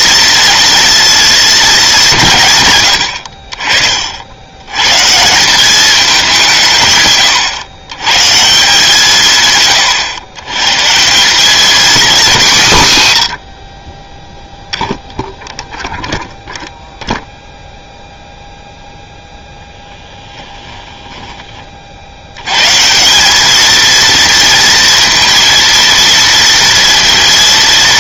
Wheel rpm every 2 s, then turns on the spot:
230, 110, 120, 140, 160, 150, 150, 0, 0, 0, 10, 140, 230, 230.
20-22